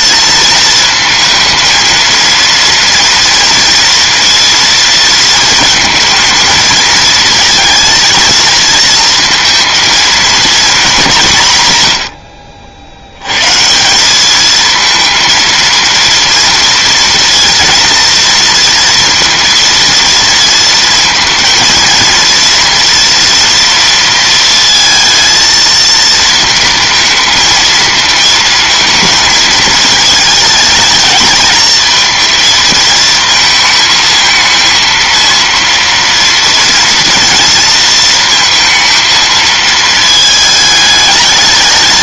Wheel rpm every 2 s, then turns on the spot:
220, 230, 230, 230, 230, 210, 80, 220, 230, 230, 230, 230, 230, 230, 230, 220, 220, 230, 230, 230, 220.
none